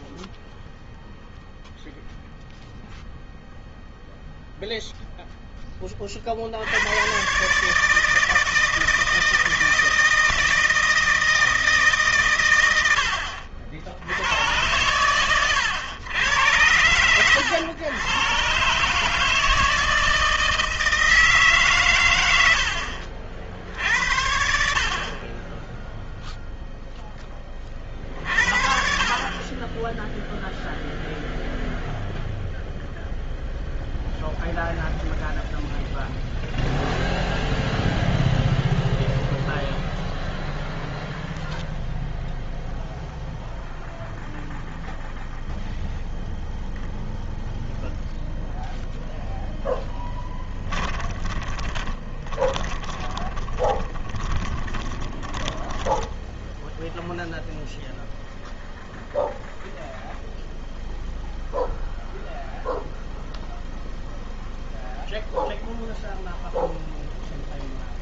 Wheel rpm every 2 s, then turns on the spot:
0, 0, 0, 90, 160, 160, 100, 110, 110, 140, 160, 80, 60, 0, 50, 0, 0, 0, 0, 0, 0, 0, 0, 0, 0, 10, 10, 20, 0, 0, 0, 0, 0, 0.
50-56